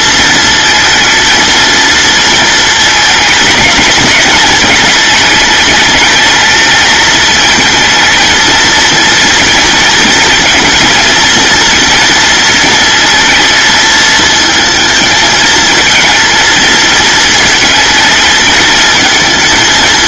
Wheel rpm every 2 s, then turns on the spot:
230, 220, 220, 220, 230, 230, 220, 220, 220, 220.
none